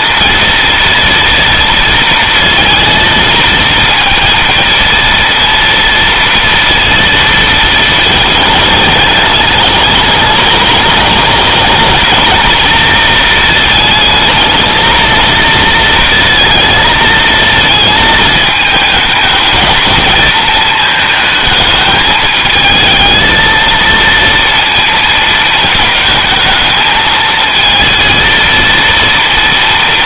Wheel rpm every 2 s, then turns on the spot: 230, 230, 230, 230, 210, 210, 220, 230, 220, 220, 220, 220, 220, 220, 230.
none